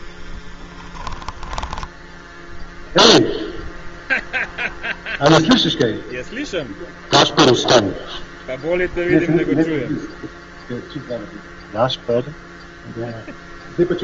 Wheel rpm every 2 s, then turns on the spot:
20, 0, 0, 0, 0, 0, 0.
0-2